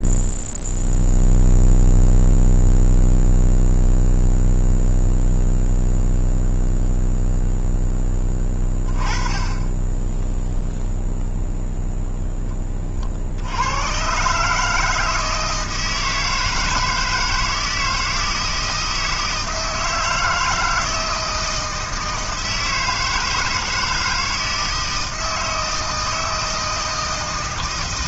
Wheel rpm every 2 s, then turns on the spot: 0, 0, 0, 0, 20, 0, 10, 140, 160, 160, 160, 160, 160, 160.
none